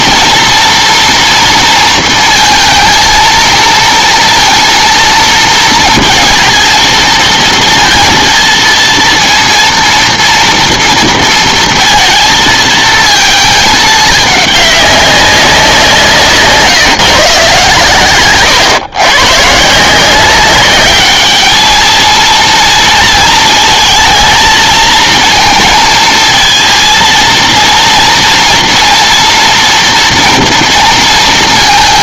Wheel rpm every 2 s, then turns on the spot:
230, 230, 230, 220, 230, 230, 220, 200, 150, 120, 200, 230, 220, 220, 230, 230.
none